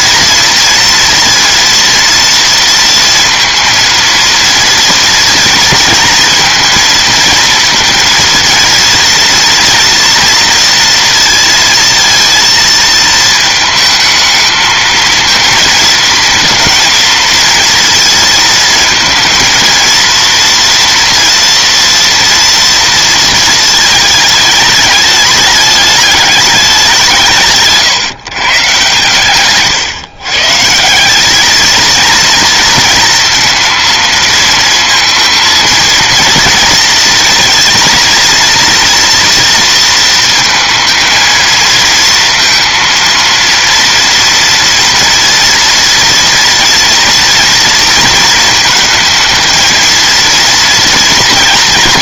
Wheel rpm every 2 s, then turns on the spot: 230, 230, 230, 230, 230, 230, 220, 220, 230, 220, 240, 230, 210, 190, 140, 140, 230, 230, 230, 230, 230, 230, 230, 230, 230, 230.
none